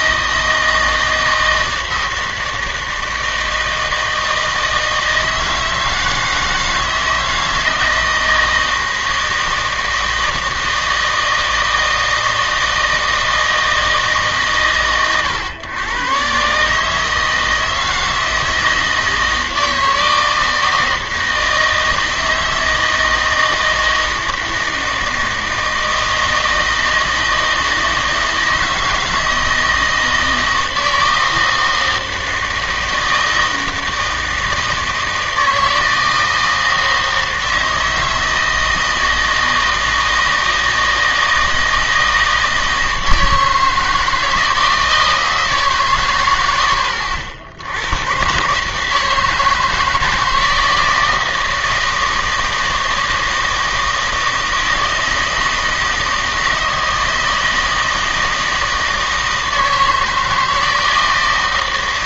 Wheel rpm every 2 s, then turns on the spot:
160, 160, 160, 160, 160, 160, 160, 120, 140, 160, 160, 160, 160, 160, 160, 160, 160, 160, 160, 160, 160, 160, 160, 90, 140, 160, 160, 160, 160, 160, 160.
none